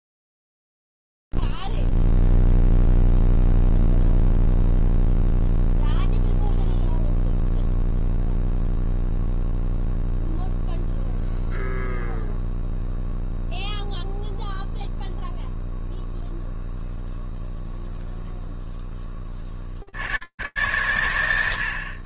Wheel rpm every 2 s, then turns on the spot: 0, 0, 0, 0, 0, 0, 0, 0, 0, 0, 110.
none